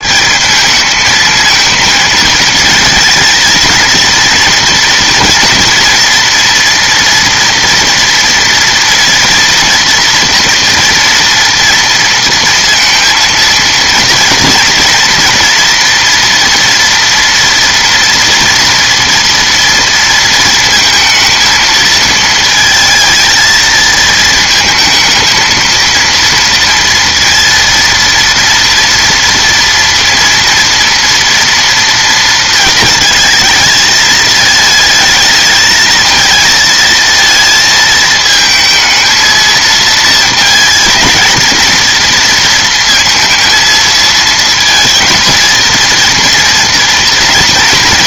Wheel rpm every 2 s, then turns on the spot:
210, 220, 230, 230, 230, 240, 230, 230, 230, 230, 230, 220, 220, 230, 230, 230, 220, 220, 220, 220, 230, 230, 220, 230.
none